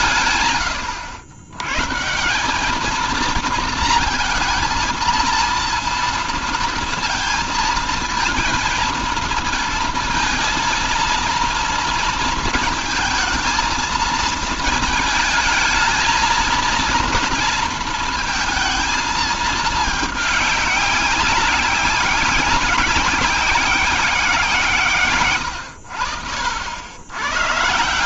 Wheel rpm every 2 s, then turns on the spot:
110, 210, 230, 230, 220, 230, 230, 220, 230, 230, 200, 190, 150, 90.
none